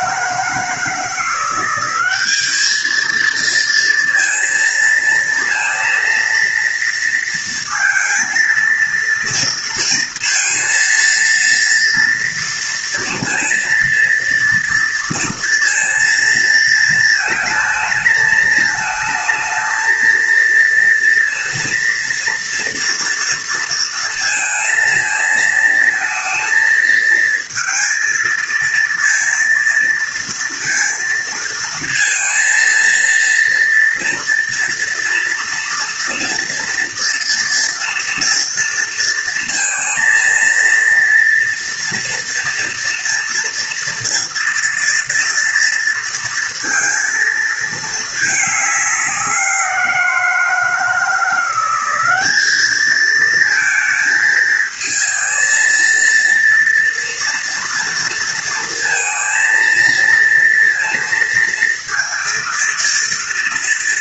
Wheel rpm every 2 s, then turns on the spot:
160, 210, 230, 230, 230, 230, 230, 230, 220, 220, 230, 230, 230, 230, 230, 230, 230, 230, 230, 230, 230, 230, 240, 230, 210, 170, 210, 220, 230, 230, 230, 230.
none